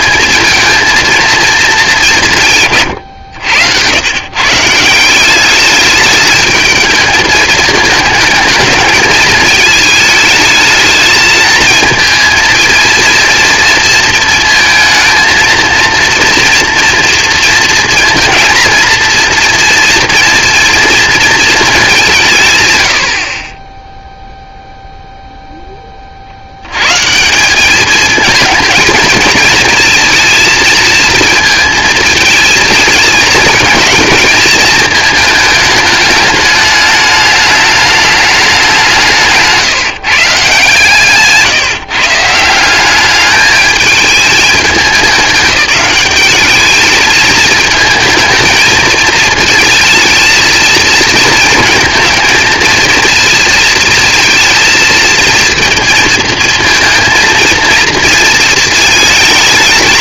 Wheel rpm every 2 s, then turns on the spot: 230, 140, 150, 210, 220, 220, 230, 220, 230, 230, 230, 140, 0, 90, 220, 230, 220, 220, 210, 200, 150, 180, 210, 210, 220, 220, 230, 230, 230, 220.
none